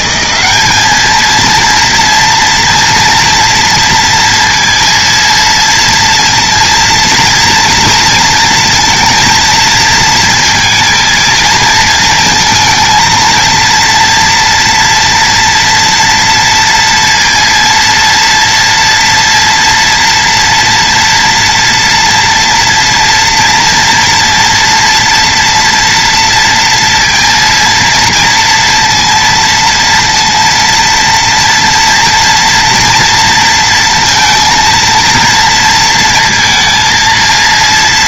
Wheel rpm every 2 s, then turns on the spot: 210, 230, 230, 230, 230, 230, 230, 230, 230, 230, 230, 230, 230, 230, 230, 230, 240, 230, 230.
none